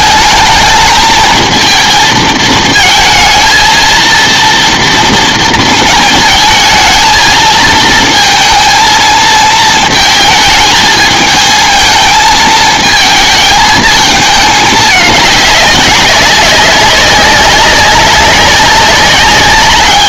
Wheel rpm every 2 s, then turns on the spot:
220, 220, 230, 220, 230, 220, 220, 210, 200, 200.
none